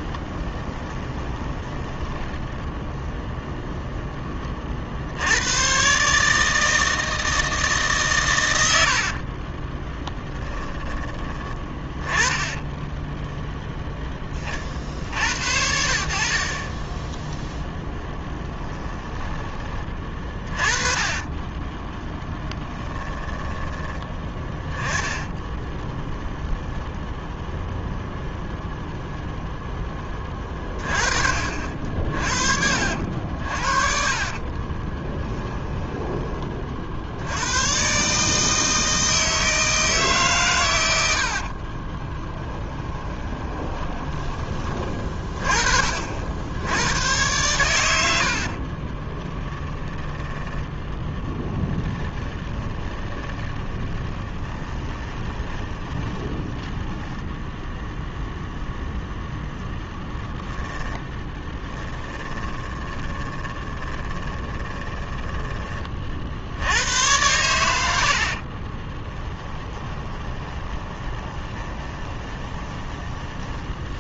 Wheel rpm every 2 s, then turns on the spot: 20, 0, 40, 160, 80, 10, 10, 40, 20, 10, 30, 10, 10, 10, 0, 30, 60, 20, 50, 160, 100, 20, 40, 100, 30, 10, 30, 20, 10, 0, 10, 10, 10, 90, 30, 20, 10.
0-2 8-10 12-14 18-28 34-36 42-44 48-58 60-66 68-74